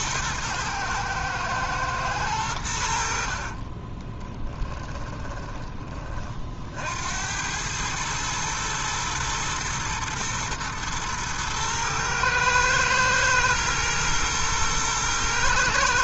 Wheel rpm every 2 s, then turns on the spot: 110, 90, 20, 50, 110, 120, 110, 110.
4-6